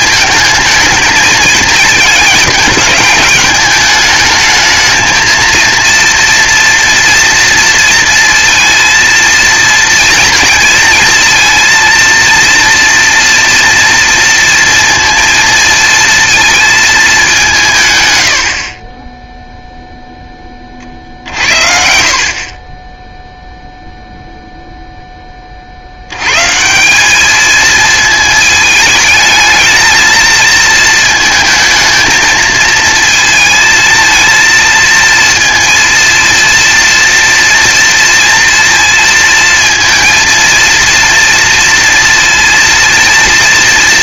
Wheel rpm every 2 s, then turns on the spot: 220, 210, 220, 230, 230, 230, 240, 230, 220, 50, 30, 20, 0, 160, 220, 230, 220, 230, 230, 230, 230, 230.
none